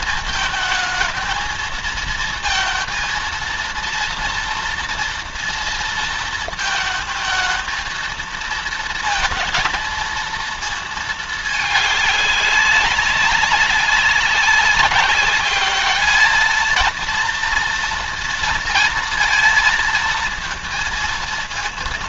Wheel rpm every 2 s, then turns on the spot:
220, 230, 230, 220, 230, 220, 200, 200, 220, 230, 230.
none